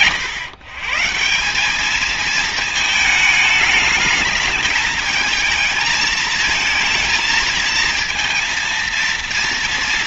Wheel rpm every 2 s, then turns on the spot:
130, 220, 210, 220, 230.
none